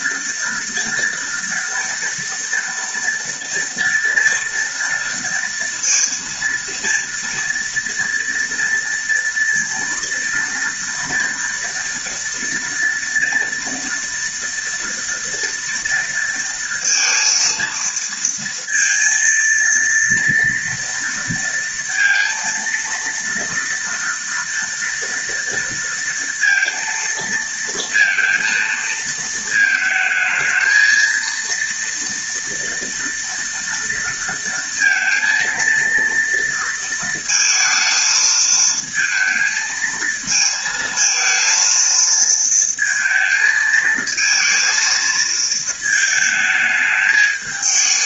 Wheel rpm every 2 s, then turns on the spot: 230, 230, 230, 230, 230, 230, 230, 230, 230, 230, 230, 230, 230, 230, 230, 220, 230, 230, 230, 220, 220, 220, 230, 220.
none